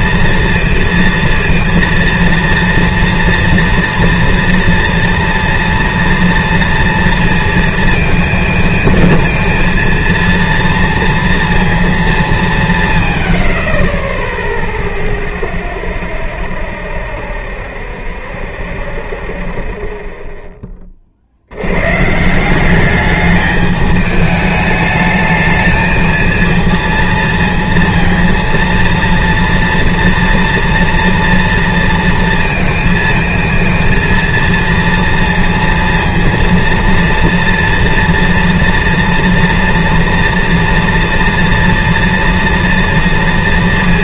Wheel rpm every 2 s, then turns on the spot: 230, 230, 230, 230, 230, 230, 190, 10, 0, 0, 0, 150, 210, 220, 230, 230, 230, 230, 230, 230, 230, 230.
none